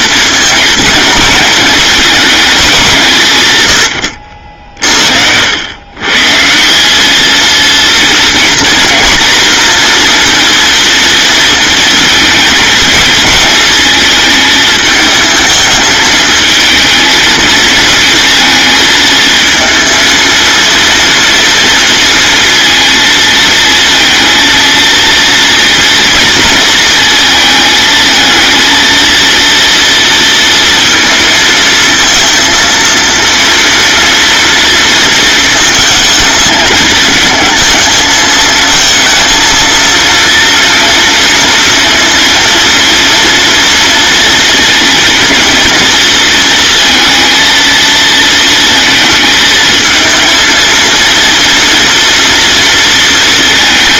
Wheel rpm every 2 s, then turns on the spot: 220, 170, 70, 220, 230, 220, 220, 220, 220, 220, 230, 230, 230, 220, 230, 230, 230, 230, 220, 230, 230, 230, 230, 230, 230, 230, 230.
none